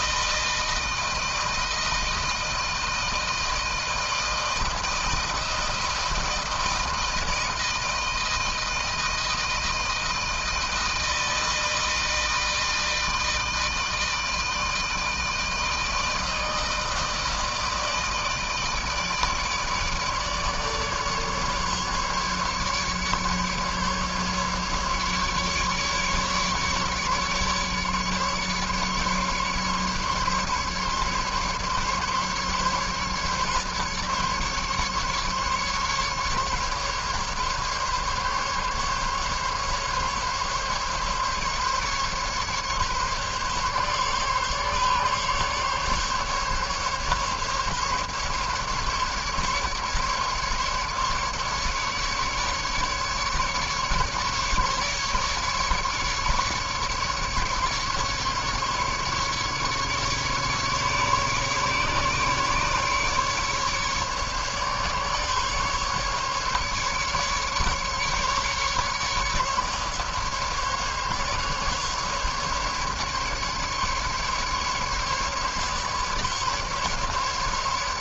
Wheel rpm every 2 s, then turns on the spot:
160, 160, 160, 160, 160, 160, 160, 160, 160, 160, 150, 150, 150, 150, 150, 140, 140, 140, 140, 140, 140, 140, 140, 140, 150, 150, 150, 150, 150, 140, 140, 150, 140, 150, 150, 150, 150, 150, 150.
none